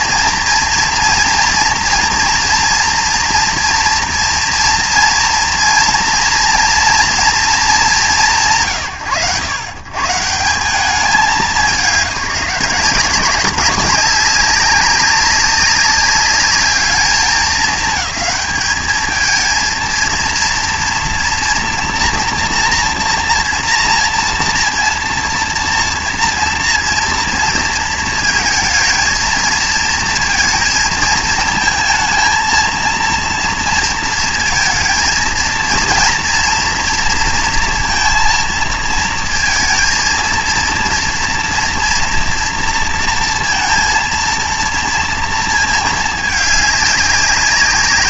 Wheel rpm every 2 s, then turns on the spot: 230, 230, 230, 230, 100, 190, 180, 200, 210, 220, 230, 240, 240, 230, 230, 230, 230, 230, 230, 230, 230, 230, 230, 200.
none